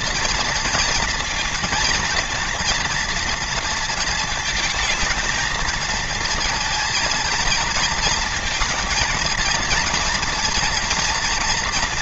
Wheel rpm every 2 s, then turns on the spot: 230, 230, 220, 230, 230, 230.
none